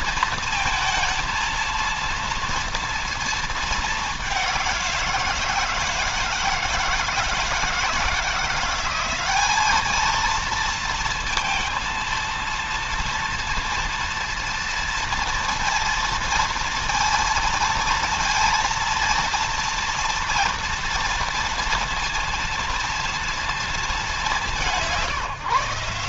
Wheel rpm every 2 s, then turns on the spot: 230, 230, 180, 160, 180, 230, 230, 230, 230, 230, 230, 230, 170.
none